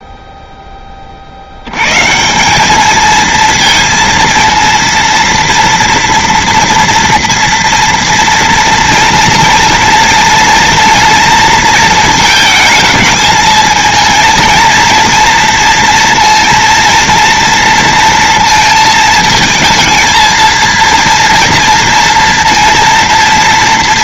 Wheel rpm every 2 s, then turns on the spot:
10, 200, 230, 230, 230, 230, 220, 230, 230, 220, 230, 230.
none